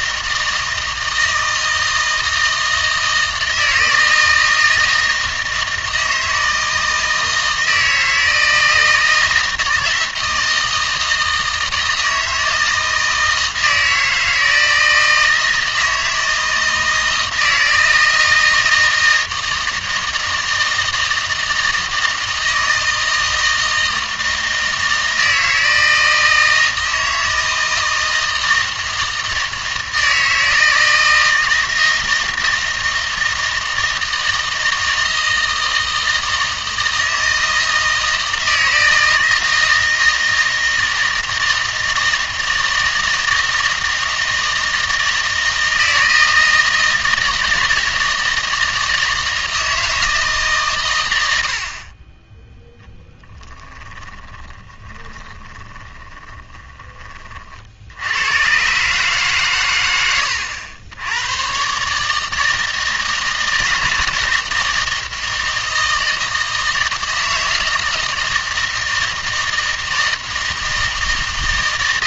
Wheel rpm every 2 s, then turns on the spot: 160, 160, 160, 160, 160, 160, 160, 160, 160, 160, 160, 160, 160, 160, 160, 160, 160, 160, 160, 160, 160, 160, 160, 160, 160, 140, 0, 20, 30, 130, 90, 160, 160, 160, 160, 160.
54-58